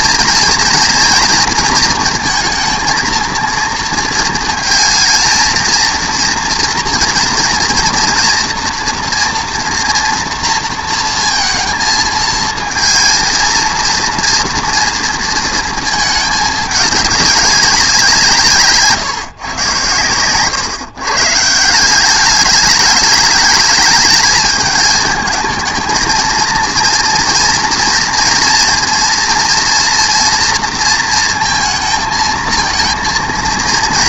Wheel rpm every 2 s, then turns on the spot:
230, 230, 220, 240, 240, 230, 220, 230, 210, 150, 130, 200, 210, 230, 230, 230, 230.
none